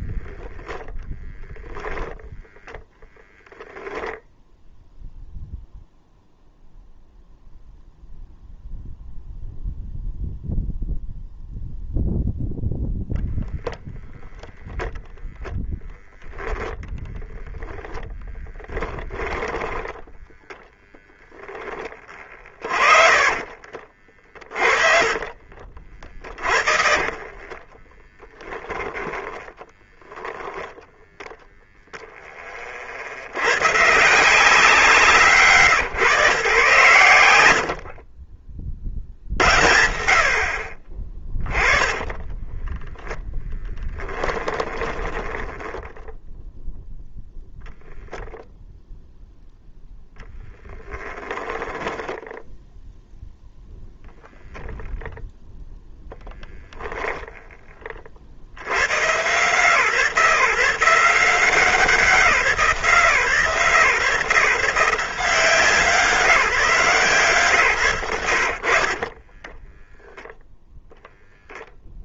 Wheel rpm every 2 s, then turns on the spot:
0, 0, 0, 0, 0, 0, 0, 0, 10, 10, 0, 40, 40, 40, 20, 0, 20, 170, 130, 50, 40, 10, 10, 0, 0, 10, 10, 0, 0, 40, 140, 180, 140, 160, 90, 0.
16-20 24-30 42-46 50-52